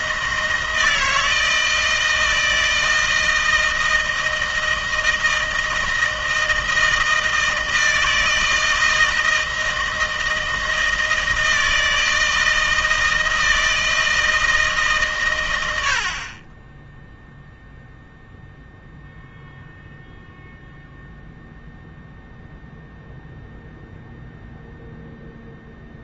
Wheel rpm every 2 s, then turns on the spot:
160, 160, 160, 160, 160, 160, 160, 160, 30, 0, 0, 0, 0.
none